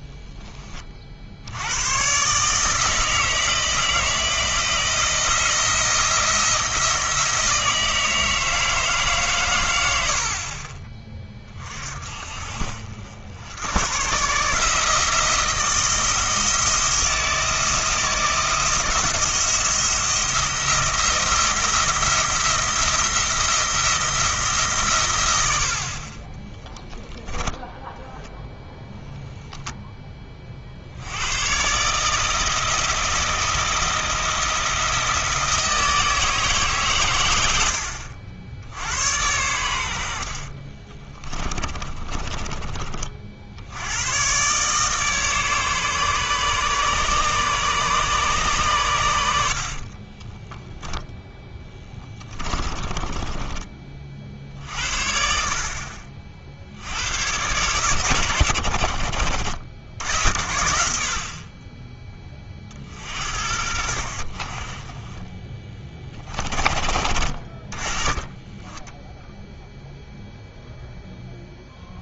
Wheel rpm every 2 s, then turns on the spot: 20, 150, 170, 160, 160, 40, 50, 160, 170, 170, 170, 170, 150, 20, 0, 50, 160, 170, 150, 70, 40, 20, 130, 140, 120, 10, 20, 60, 70, 80, 60, 40, 40, 30, 10, 0.
26-28 40-44 52-54